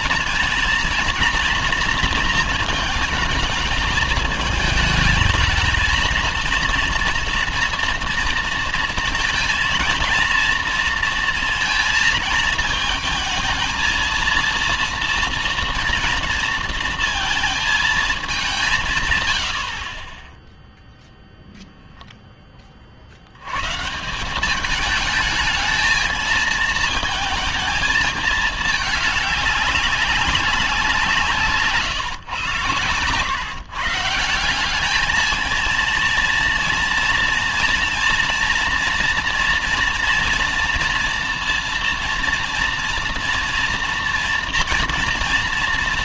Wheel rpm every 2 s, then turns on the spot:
230, 230, 210, 230, 230, 230, 220, 230, 230, 200, 10, 20, 200, 220, 220, 190, 130, 190, 230, 230, 230, 230, 230.
none